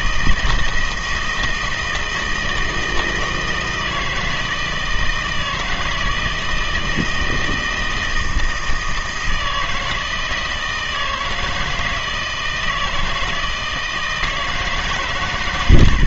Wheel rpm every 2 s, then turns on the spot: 160, 160, 160, 160, 160, 160, 160, 150.
none